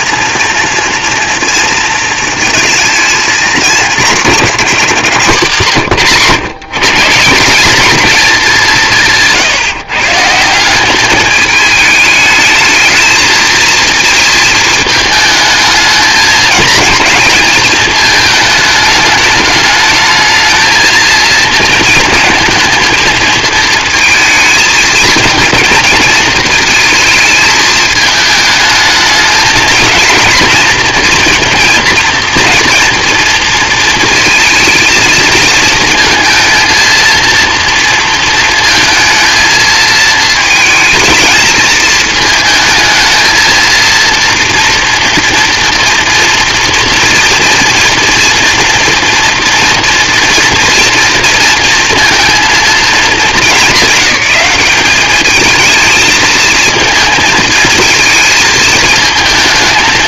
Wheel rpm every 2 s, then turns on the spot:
230, 220, 230, 150, 200, 170, 220, 220, 230, 210, 220, 220, 230, 220, 210, 230, 230, 230, 230, 230, 220, 220, 230, 240, 230, 230, 220, 190, 220, 220.
none